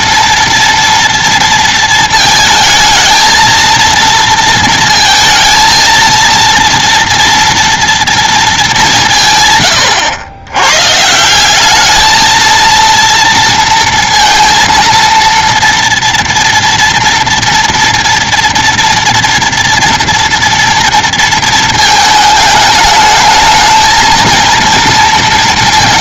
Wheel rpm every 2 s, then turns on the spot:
230, 220, 220, 230, 190, 130, 230, 230, 230, 230, 230, 210, 230.
none